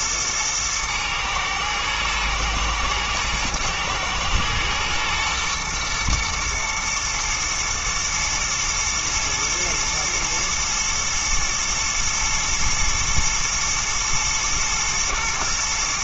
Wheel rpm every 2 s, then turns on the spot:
110, 110, 110, 120, 110, 110, 110, 120.
none